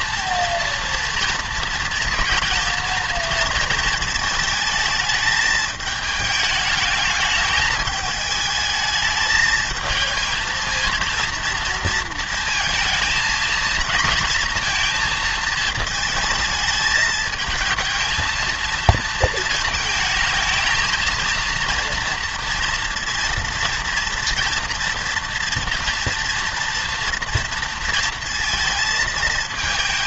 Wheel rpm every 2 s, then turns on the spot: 230, 230, 220, 210, 220, 220, 230, 230, 220, 220, 220, 230, 230, 230, 230.
none